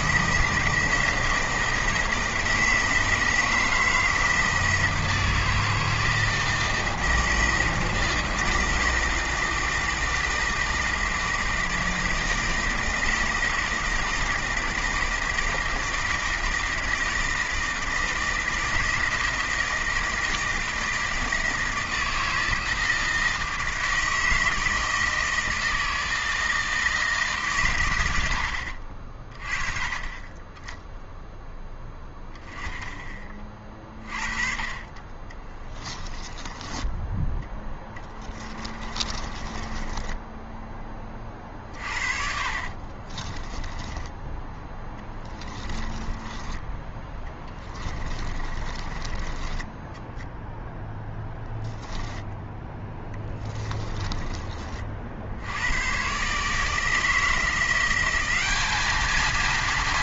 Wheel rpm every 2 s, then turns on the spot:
160, 160, 160, 160, 160, 160, 160, 160, 160, 160, 160, 160, 160, 160, 80, 10, 10, 40, 20, 20, 20, 50, 10, 20, 30, 0, 10, 40, 150, 200.
36-40 42-46 48-50